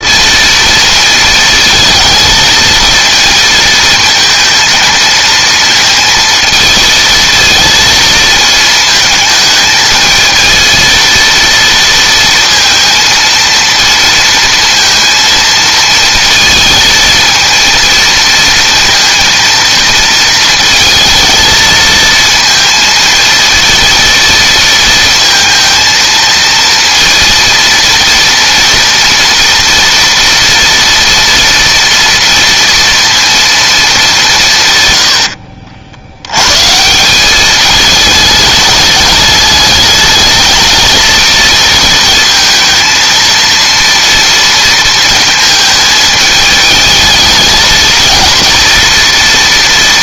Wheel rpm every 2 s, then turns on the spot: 230, 230, 220, 220, 220, 230, 230, 230, 230, 230, 230, 230, 230, 230, 230, 230, 230, 120, 160, 210, 220, 230, 230, 220, 230.
34-36